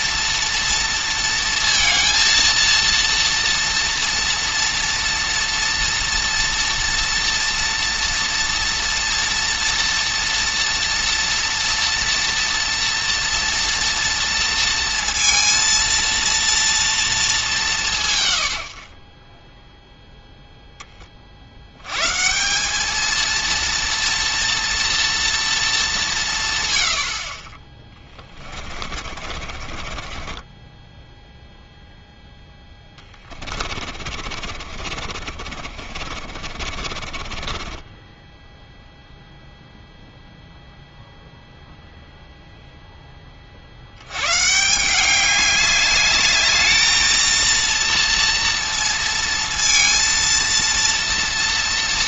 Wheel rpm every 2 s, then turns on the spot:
230, 230, 230, 230, 230, 230, 230, 230, 230, 50, 20, 210, 230, 90, 40, 10, 20, 40, 40, 0, 0, 10, 180, 220, 230, 230.
28-38